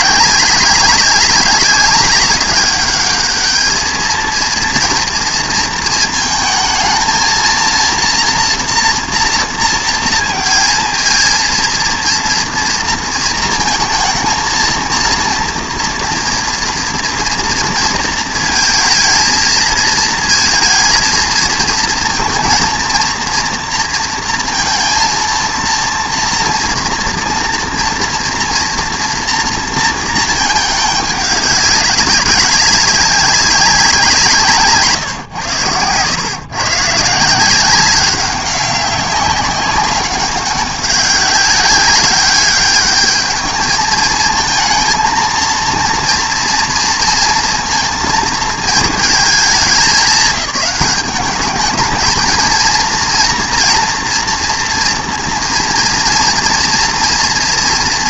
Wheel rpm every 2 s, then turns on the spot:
200, 210, 230, 220, 230, 230, 230, 230, 230, 220, 230, 230, 230, 230, 240, 210, 190, 160, 140, 200, 190, 210, 230, 230, 220, 210, 230, 230, 230.
34-36